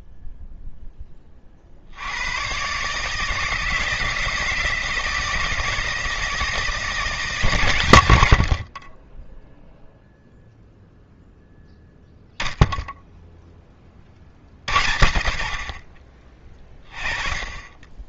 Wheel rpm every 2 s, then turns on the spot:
50, 160, 160, 130, 0, 0, 30, 40, 20.
none